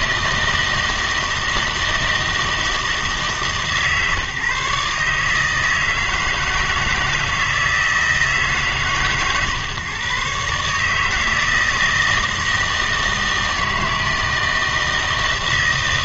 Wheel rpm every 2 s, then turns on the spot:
160, 160, 140, 160, 150, 150, 160, 160.
none